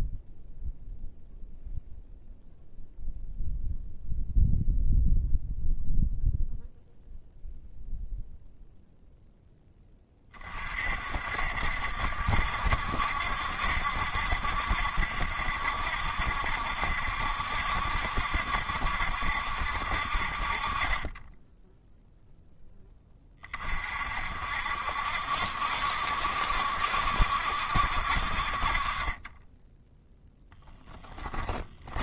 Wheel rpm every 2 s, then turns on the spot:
0, 0, 0, 0, 0, 40, 60, 70, 70, 70, 50, 10, 60, 60, 40, 10.
30-32